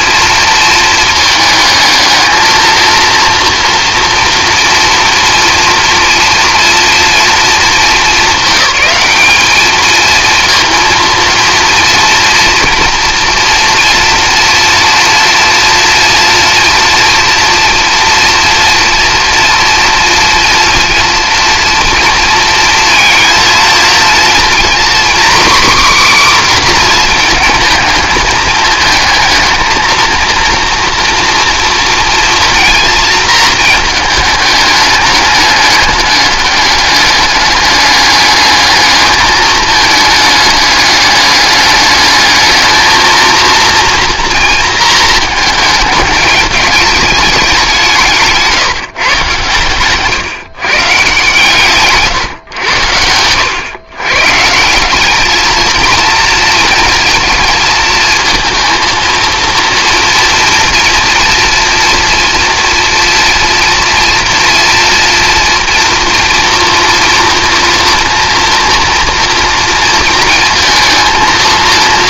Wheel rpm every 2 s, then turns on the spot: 230, 230, 230, 230, 210, 230, 230, 230, 240, 230, 230, 230, 250, 250, 220, 240, 230, 210, 200, 210, 210, 220, 230, 210, 160, 140, 90, 180, 220, 230, 230, 230, 230, 230, 230, 230.
none